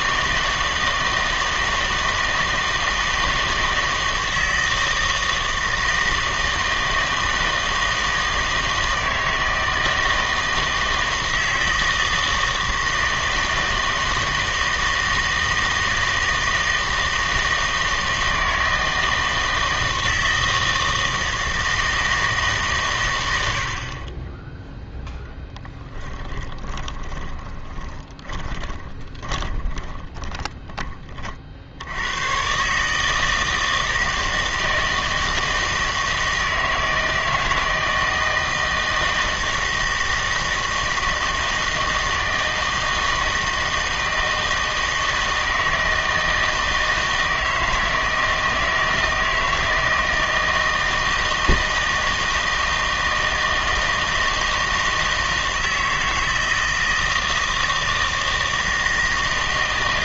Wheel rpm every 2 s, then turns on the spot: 160, 160, 160, 160, 160, 160, 160, 160, 160, 160, 160, 130, 0, 20, 20, 30, 140, 160, 160, 160, 160, 160, 160, 160, 160, 160, 160, 160, 160, 160.
26-32